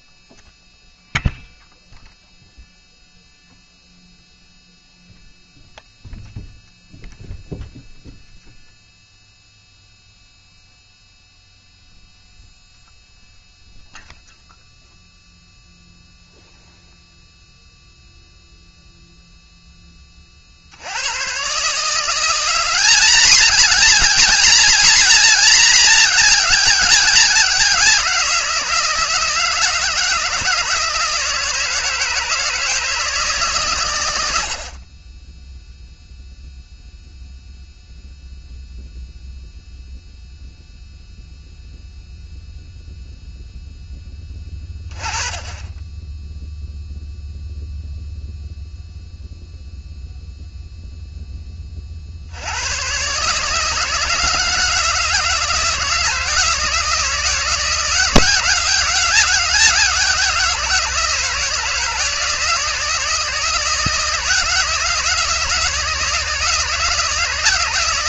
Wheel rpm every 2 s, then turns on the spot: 0, 0, 0, 0, 0, 0, 0, 0, 0, 0, 70, 190, 240, 220, 170, 160, 160, 60, 0, 0, 0, 0, 20, 0, 0, 0, 100, 160, 170, 180, 160, 160, 170, 160.
none